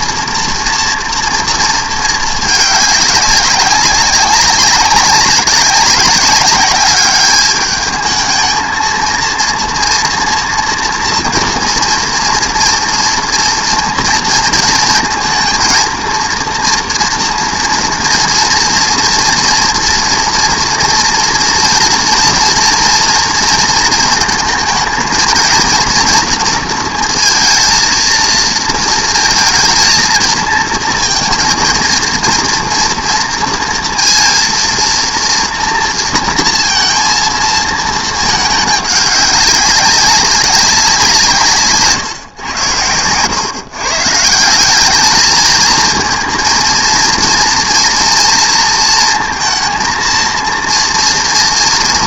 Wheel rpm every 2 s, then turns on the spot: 240, 210, 190, 200, 230, 230, 230, 230, 240, 230, 230, 230, 220, 230, 220, 230, 230, 230, 230, 210, 190, 100, 200, 230, 230, 240.
none